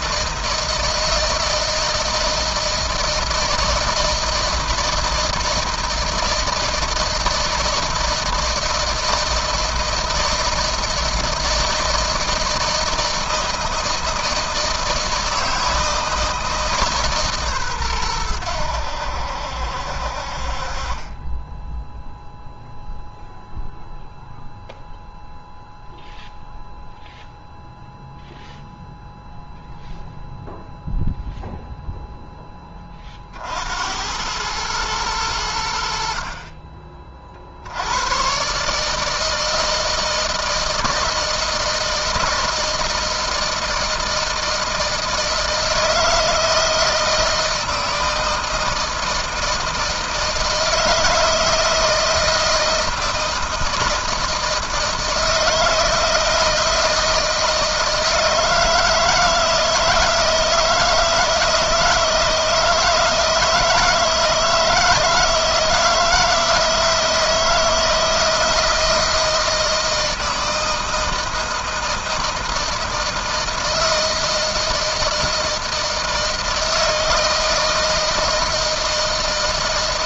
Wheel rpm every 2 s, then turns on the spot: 160, 160, 160, 160, 160, 160, 160, 160, 150, 80, 30, 0, 0, 0, 0, 0, 30, 100, 40, 150, 160, 160, 160, 160, 160, 160, 160, 160, 160, 160, 160, 160, 160, 160, 160, 160, 160, 160, 160, 160.
none